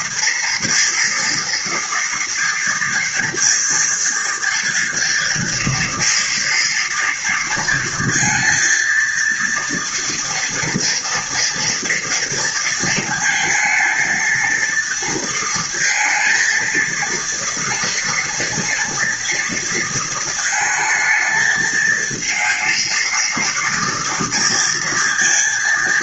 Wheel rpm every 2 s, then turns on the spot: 230, 230, 240, 230, 230, 230, 230, 230, 230, 230, 220, 230, 230.
none